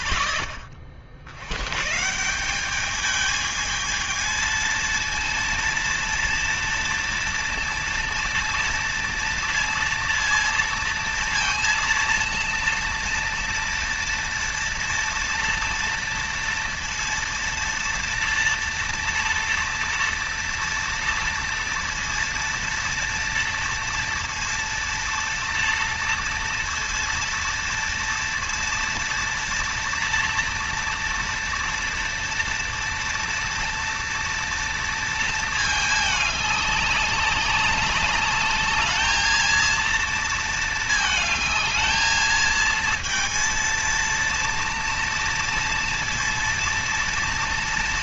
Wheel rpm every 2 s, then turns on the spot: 30, 190, 230, 230, 230, 230, 230, 230, 230, 230, 230, 230, 230, 230, 230, 230, 230, 230, 200, 210, 220, 220, 230, 230.
none